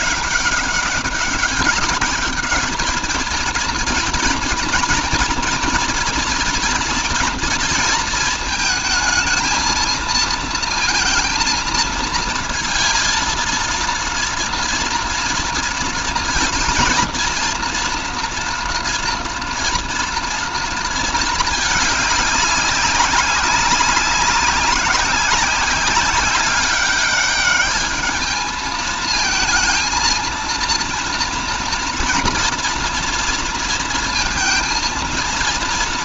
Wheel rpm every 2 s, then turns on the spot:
200, 210, 230, 230, 220, 230, 230, 230, 230, 230, 220, 200, 190, 200, 220, 230, 230, 230.
none